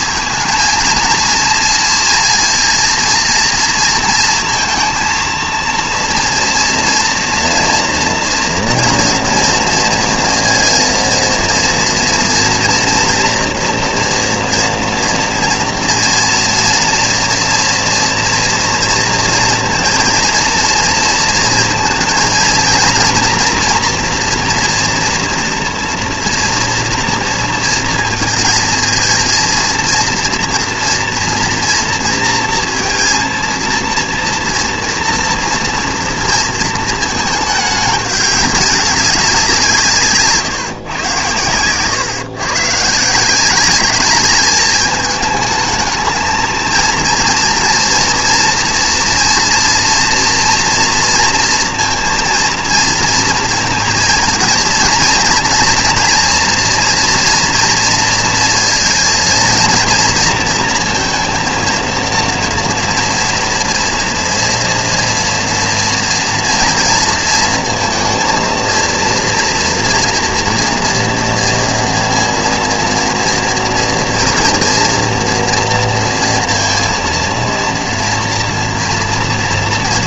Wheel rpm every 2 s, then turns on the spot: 220, 230, 230, 230, 230, 230, 230, 230, 230, 230, 230, 230, 240, 240, 230, 240, 230, 230, 230, 200, 150, 120, 210, 220, 230, 230, 230, 230, 240, 230, 230, 230, 240, 230, 230, 230, 230, 230, 230, 230.
none